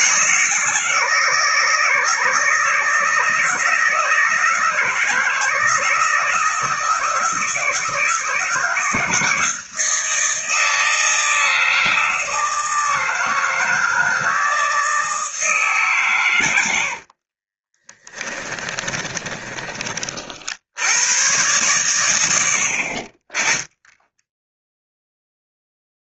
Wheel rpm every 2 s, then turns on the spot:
160, 160, 170, 160, 170, 160, 160, 160, 60, 10, 90, 40, 0.
16-20